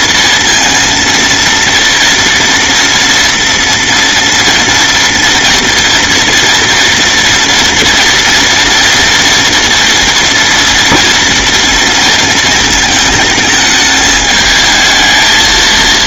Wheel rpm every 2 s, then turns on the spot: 230, 240, 230, 230, 230, 230, 220, 220.
none